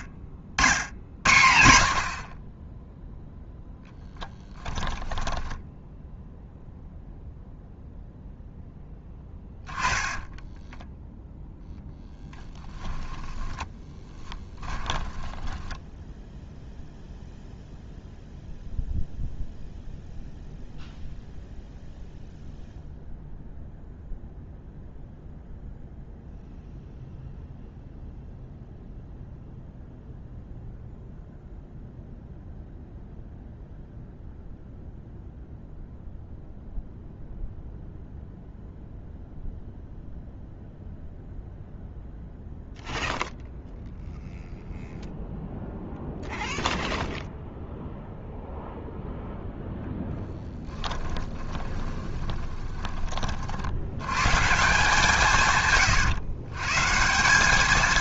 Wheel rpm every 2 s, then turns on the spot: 100, 10, 10, 0, 10, 0, 10, 10, 0, 0, 0, 0, 0, 0, 0, 0, 0, 0, 0, 0, 0, 0, 0, 0, 0, 10, 30, 160, 150.
4-6 12-16 50-52